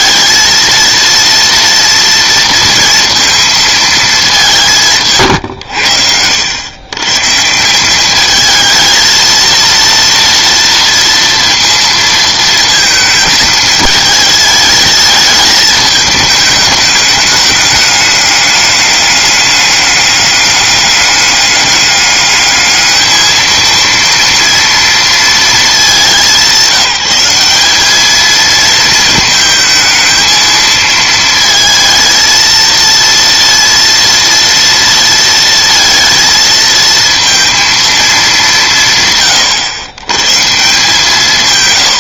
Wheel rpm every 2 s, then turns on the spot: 230, 230, 170, 100, 220, 230, 220, 220, 210, 200, 200, 210, 230, 200, 220, 220, 230, 230, 220, 170, 150.
none